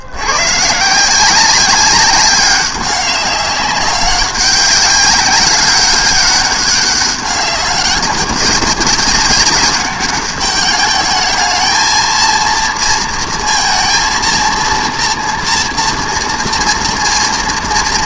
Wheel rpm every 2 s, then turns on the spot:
130, 200, 200, 200, 190, 200, 230, 230, 230.
none